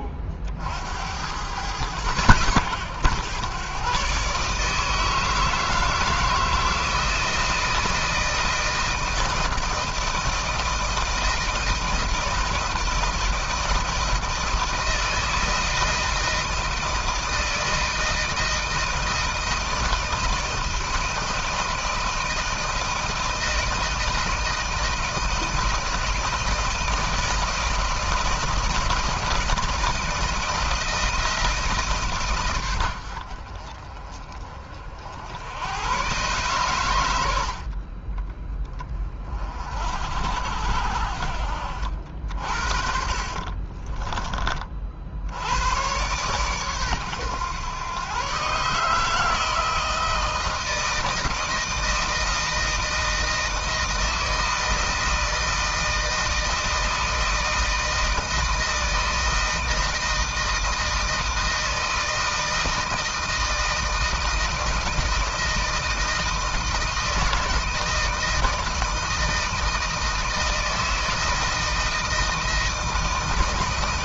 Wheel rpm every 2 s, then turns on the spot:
70, 110, 150, 160, 160, 160, 160, 160, 160, 160, 160, 160, 160, 160, 160, 160, 80, 60, 110, 20, 70, 60, 60, 120, 150, 160, 160, 160, 160, 160, 160, 160, 160, 160, 160, 160, 160.
42-44